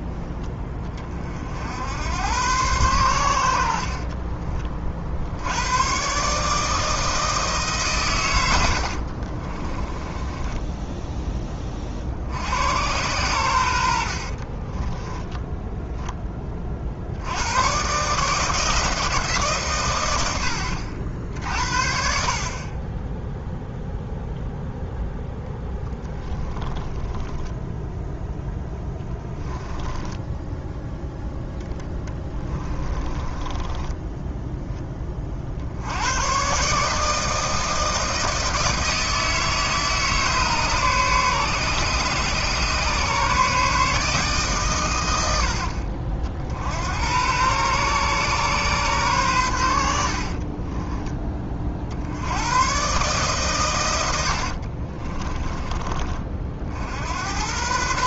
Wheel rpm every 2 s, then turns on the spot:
30, 100, 40, 160, 60, 10, 100, 20, 60, 160, 70, 10, 0, 10, 10, 0, 20, 20, 150, 160, 140, 140, 100, 90, 130, 20, 130, 40, 70.
8-10 14-16 26-30 32-34 50-52 54-56